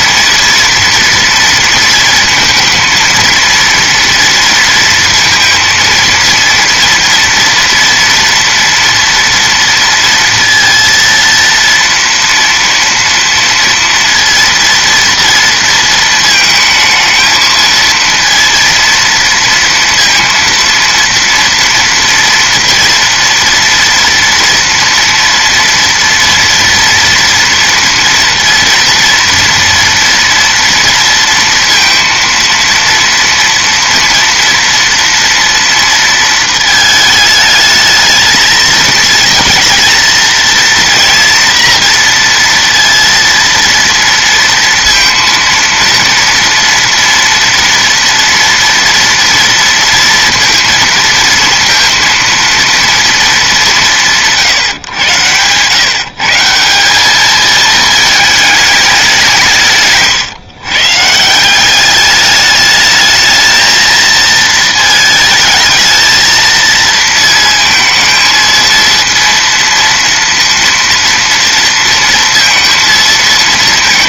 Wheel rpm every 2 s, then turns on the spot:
230, 230, 230, 230, 230, 230, 230, 230, 220, 230, 230, 240, 230, 230, 230, 230, 230, 230, 220, 230, 230, 230, 230, 230, 230, 230, 220, 130, 210, 190, 160, 220, 220, 230, 230, 230, 220.
none